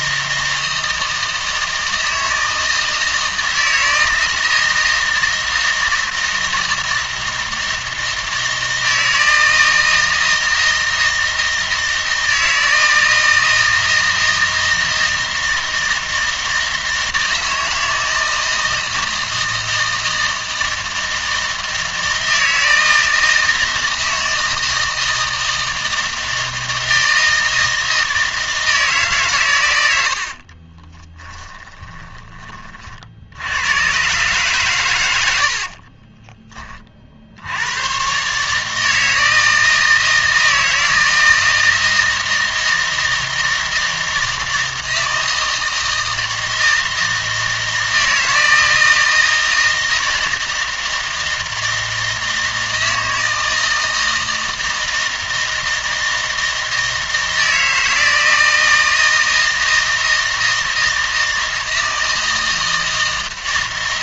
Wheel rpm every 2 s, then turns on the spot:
160, 160, 160, 160, 160, 160, 160, 160, 160, 160, 160, 160, 160, 160, 160, 30, 30, 130, 30, 150, 160, 160, 160, 160, 160, 160, 160, 160, 160, 160, 160, 160.
30-32